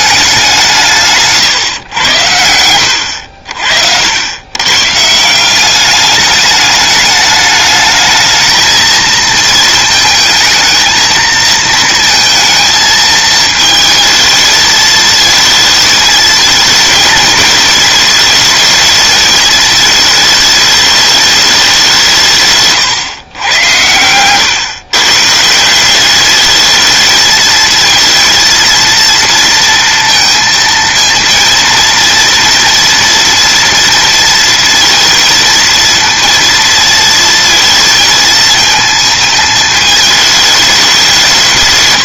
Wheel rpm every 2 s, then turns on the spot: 170, 80, 140, 210, 220, 220, 220, 220, 230, 220, 210, 140, 130, 220, 230, 230, 240, 230, 230, 220, 200.
none